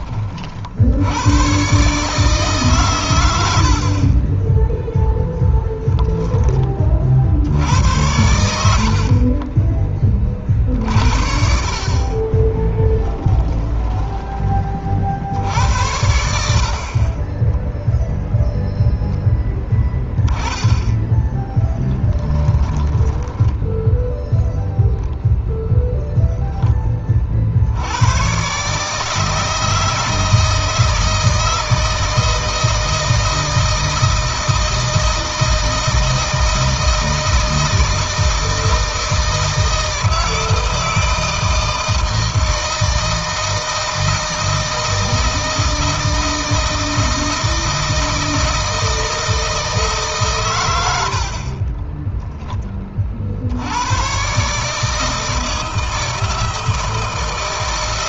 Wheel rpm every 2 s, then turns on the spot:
80, 120, 10, 40, 50, 50, 10, 50, 40, 0, 10, 10, 0, 30, 150, 160, 160, 160, 160, 160, 160, 160, 160, 160, 160, 80, 40, 160, 160.
4-6 8-10 12-14 22-24